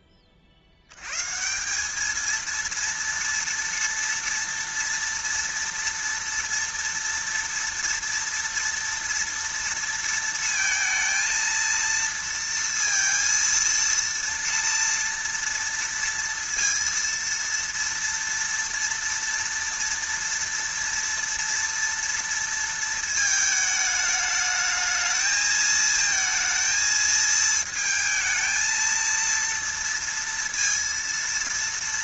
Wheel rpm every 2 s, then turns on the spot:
80, 230, 240, 230, 230, 230, 230, 230, 230, 230, 230, 220, 220, 220, 230, 230.
none